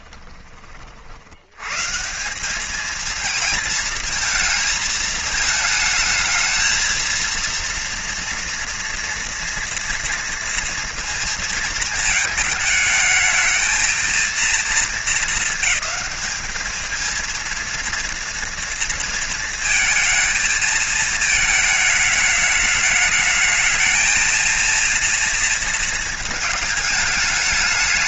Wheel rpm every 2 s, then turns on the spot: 40, 210, 220, 230, 230, 230, 220, 220, 220, 230, 220, 210, 230, 220.
none